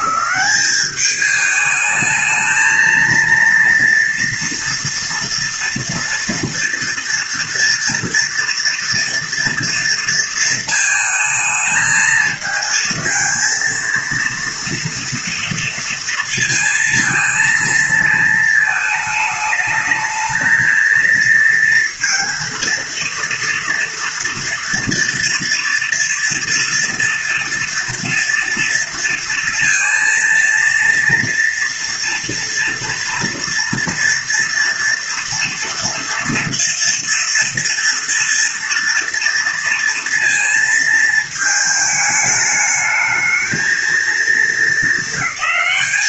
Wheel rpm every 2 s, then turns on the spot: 200, 220, 230, 230, 230, 220, 220, 230, 230, 220, 220, 230, 230, 230, 230, 230, 230, 230, 230, 230, 230, 210, 220.
none